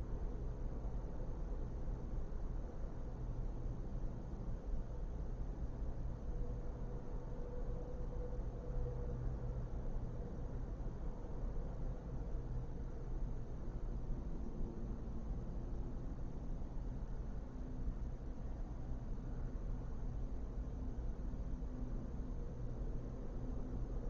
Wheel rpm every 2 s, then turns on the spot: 0, 0, 0, 0, 0, 0, 0, 0, 0, 0, 0, 0.
none